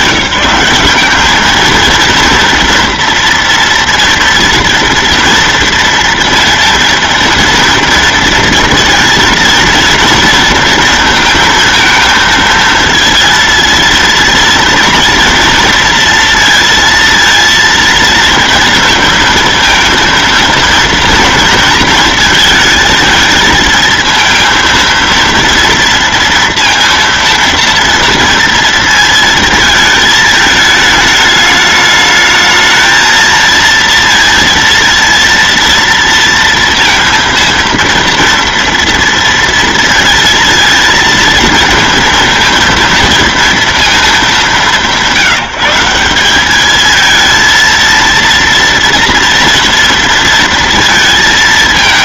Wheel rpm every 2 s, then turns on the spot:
190, 230, 230, 230, 230, 230, 230, 230, 230, 230, 230, 220, 230, 230, 230, 220, 220, 230, 230, 230, 230, 230, 190, 220, 230, 230.
none